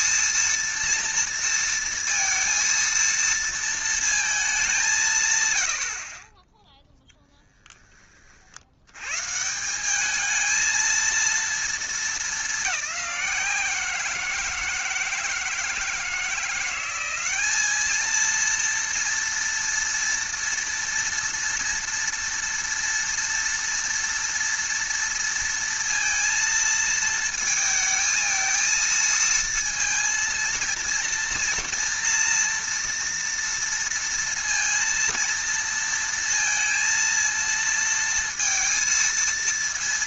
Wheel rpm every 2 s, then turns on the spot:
230, 230, 190, 10, 80, 220, 190, 160, 180, 230, 230, 230, 230, 230, 220, 230, 230, 230, 230, 230.
none